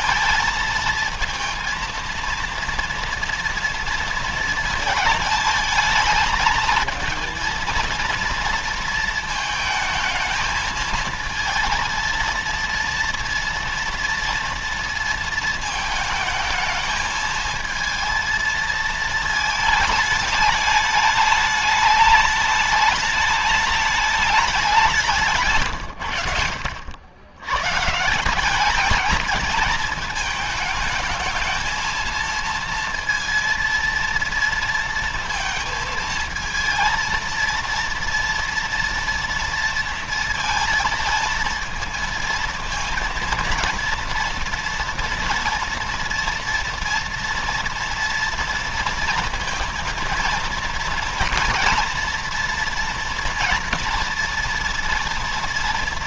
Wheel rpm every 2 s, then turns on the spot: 230, 230, 220, 220, 230, 220, 230, 230, 220, 230, 210, 210, 190, 80, 210, 220, 230, 230, 230, 230, 230, 230, 230, 230, 230, 230, 230, 230.
none